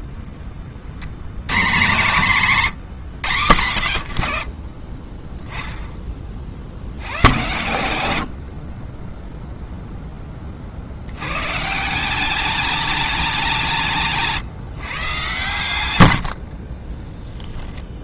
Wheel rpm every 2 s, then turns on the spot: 90, 120, 20, 100, 0, 180, 180, 100, 10.
14-18